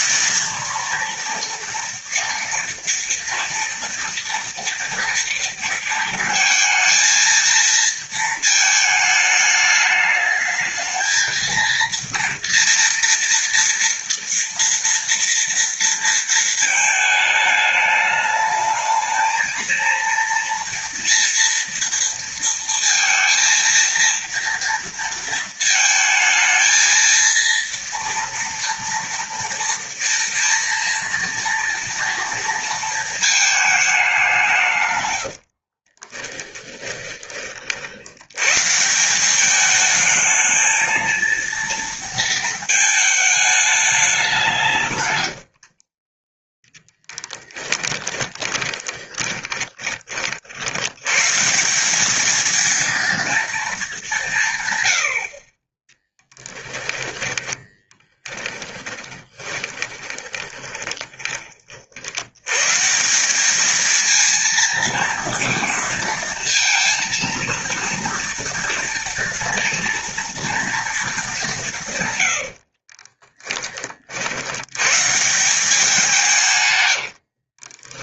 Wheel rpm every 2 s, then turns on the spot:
230, 230, 230, 230, 220, 220, 230, 230, 220, 210, 230, 230, 230, 220, 230, 230, 230, 150, 10, 130, 220, 220, 160, 20, 20, 50, 230, 160, 10, 10, 10, 140, 220, 230, 230, 230, 60, 90, 130.
36-38 46-50 56-62 72-74 76-78